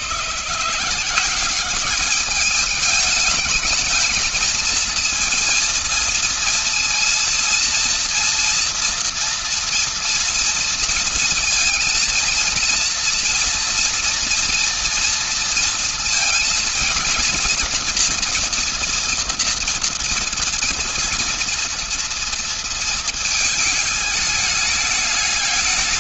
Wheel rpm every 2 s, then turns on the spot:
170, 210, 230, 230, 230, 230, 230, 230, 230, 230, 230, 230, 210.
none